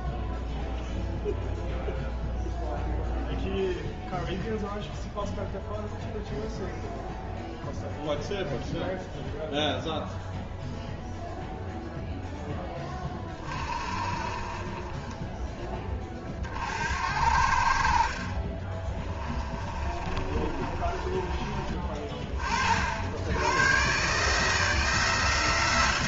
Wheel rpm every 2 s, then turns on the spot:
0, 0, 0, 0, 0, 0, 10, 40, 50, 20, 30, 50, 150.
14-16 18-22